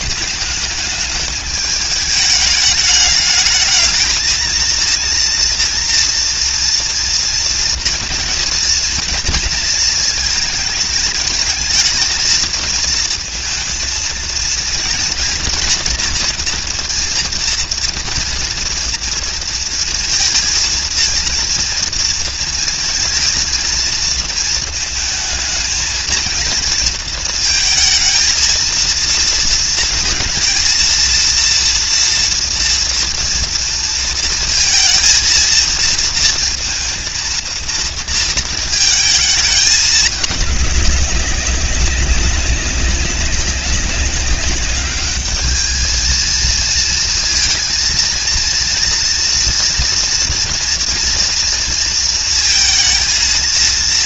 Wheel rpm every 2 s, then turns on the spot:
220, 210, 220, 230, 230, 230, 220, 220, 230, 230, 230, 230, 230, 220, 220, 230, 230, 230, 230, 230, 210, 190, 190, 220, 230, 230, 230.
none